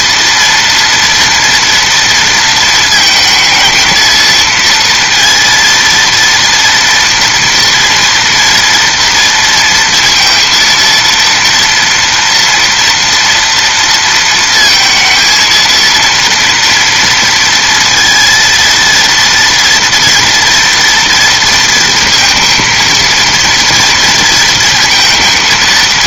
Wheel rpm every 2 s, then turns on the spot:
230, 230, 230, 230, 230, 230, 230, 230, 240, 230, 230, 220, 230.
none